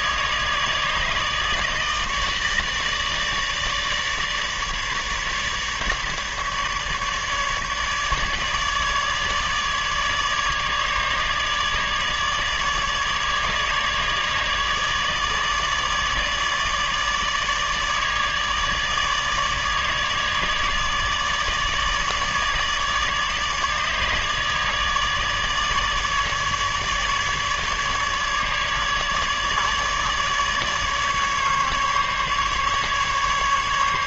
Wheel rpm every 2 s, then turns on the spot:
150, 160, 150, 150, 150, 150, 150, 150, 150, 150, 150, 150, 150, 150, 150, 150, 150.
none